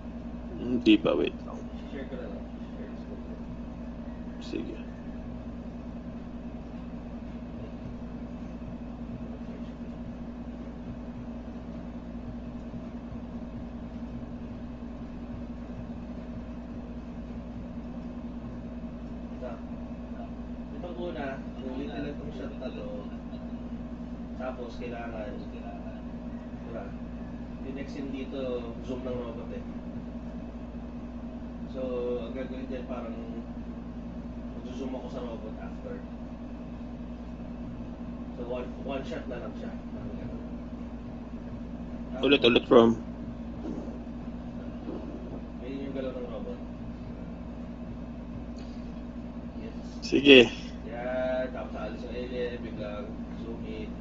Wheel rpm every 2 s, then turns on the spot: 0, 0, 0, 0, 0, 0, 0, 0, 0, 0, 0, 0, 0, 0, 0, 0, 0, 0, 0, 0, 0, 0, 0, 0, 0, 0, 0.
none